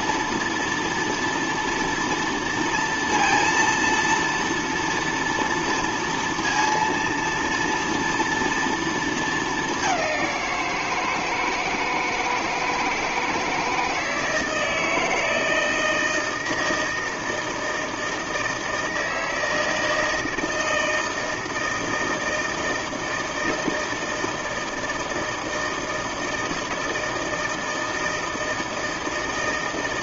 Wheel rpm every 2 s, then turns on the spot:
230, 230, 230, 230, 230, 170, 160, 160, 160, 160, 160, 160, 160, 160, 160.
none